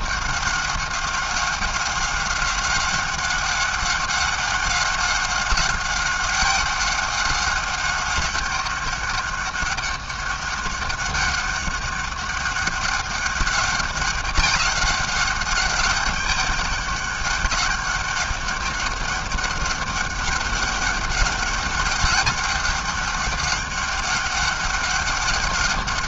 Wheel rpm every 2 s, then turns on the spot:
190, 190, 190, 200, 200, 200, 200, 200, 200, 200, 200, 200, 200.
none